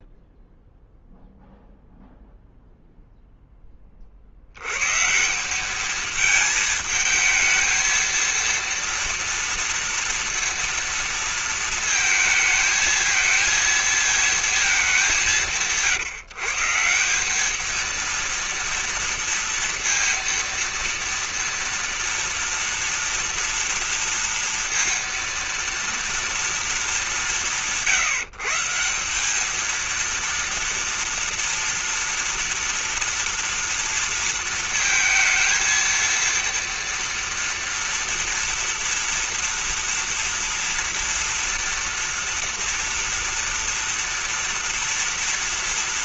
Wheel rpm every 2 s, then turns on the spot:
0, 0, 120, 220, 230, 230, 220, 210, 170, 230, 230, 230, 230, 180, 170, 230, 240, 230, 230, 240, 230, 230, 230.
none